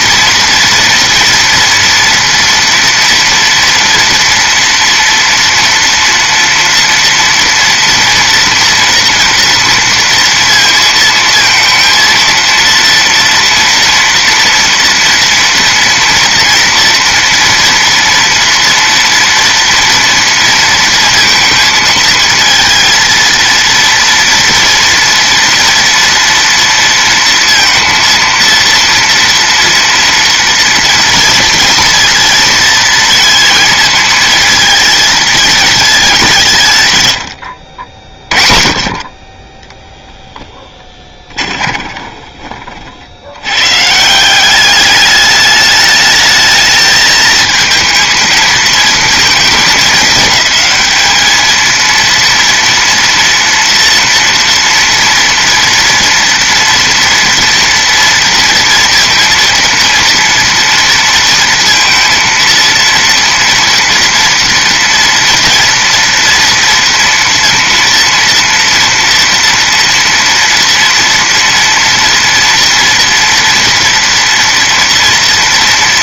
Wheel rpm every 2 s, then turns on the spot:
230, 230, 230, 230, 230, 230, 230, 230, 230, 230, 230, 230, 230, 230, 230, 230, 230, 220, 150, 40, 10, 40, 200, 220, 230, 210, 230, 230, 230, 230, 230, 230, 230, 230, 230, 230, 230, 230.
40-42